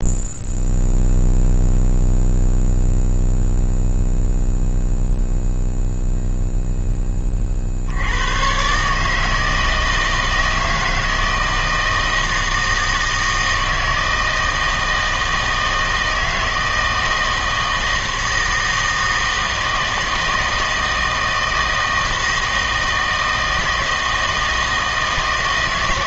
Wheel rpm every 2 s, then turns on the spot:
0, 0, 0, 0, 130, 160, 160, 160, 160, 160, 160, 160, 160.
none